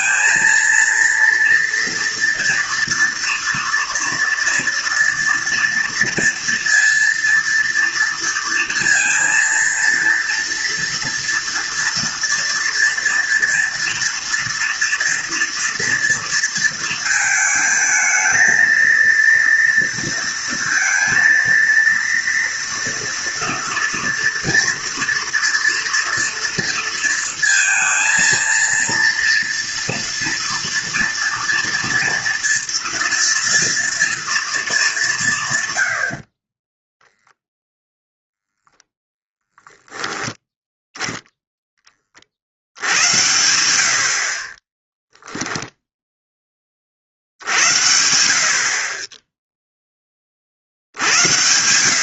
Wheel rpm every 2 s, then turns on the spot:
230, 230, 230, 230, 230, 230, 230, 240, 230, 220, 230, 230, 230, 230, 230, 230, 230, 220, 40, 0, 10, 50, 30, 20, 40, 50.
36-38